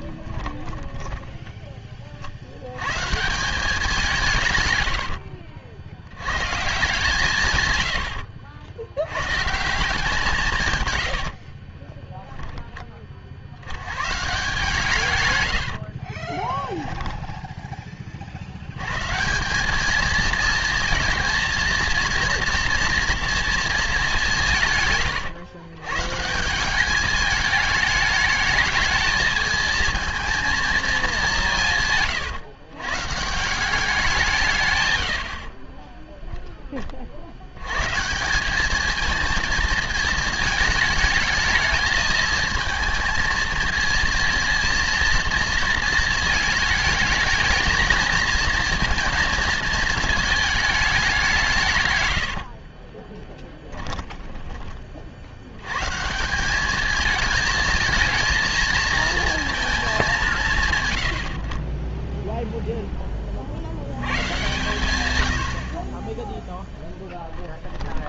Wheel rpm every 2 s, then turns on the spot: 20, 80, 120, 140, 70, 160, 10, 150, 10, 90, 230, 230, 160, 180, 220, 230, 130, 150, 10, 200, 210, 220, 230, 220, 230, 220, 50, 20, 200, 220, 140, 0, 120, 0.
0-2 4-6 16-18 52-54